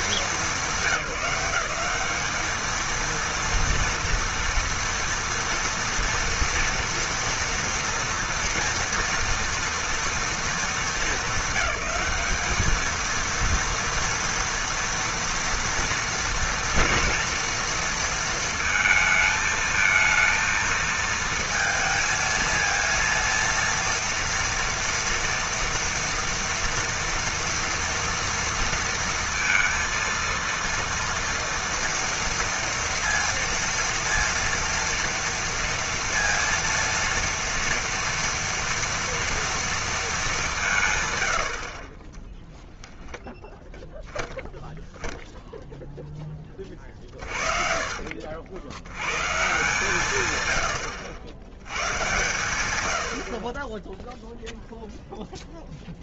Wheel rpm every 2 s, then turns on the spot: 170, 230, 230, 230, 230, 210, 230, 230, 230, 220, 220, 230, 230, 230, 230, 230, 230, 230, 230, 230, 150, 0, 0, 20, 80, 90, 120, 0.
46-48